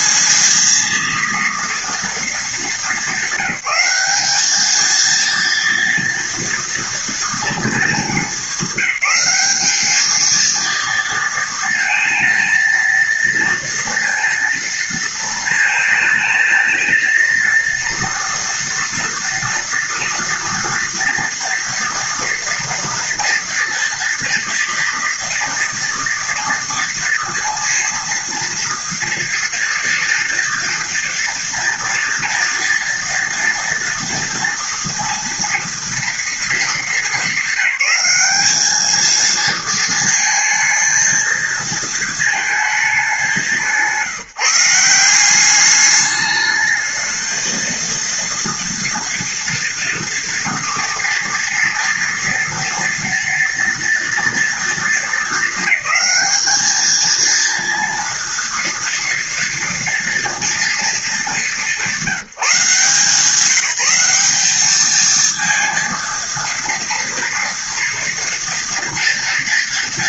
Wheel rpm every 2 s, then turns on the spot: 220, 220, 210, 230, 210, 220, 230, 230, 220, 230, 230, 230, 230, 230, 230, 230, 230, 230, 220, 200, 220, 220, 170, 210, 230, 230, 230, 230, 210, 230, 230, 180, 200, 230, 230.
none